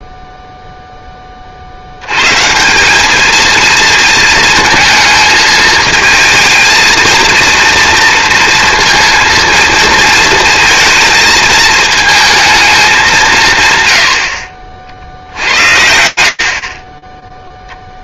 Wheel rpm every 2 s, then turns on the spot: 0, 120, 230, 230, 230, 220, 220, 80, 30.
none